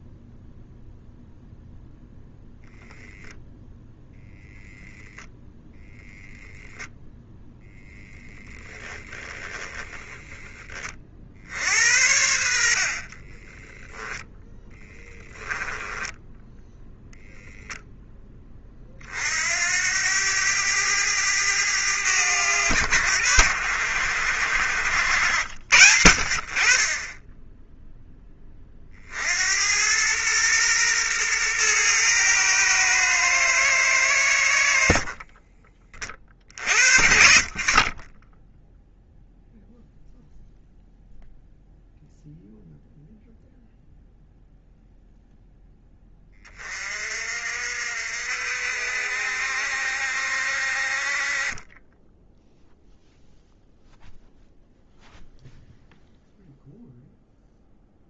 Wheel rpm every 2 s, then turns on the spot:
0, 0, 0, 0, 10, 20, 60, 10, 0, 30, 100, 90, 80, 30, 40, 120, 110, 70, 60, 0, 0, 0, 0, 40, 60, 50, 0, 0, 0.
14-16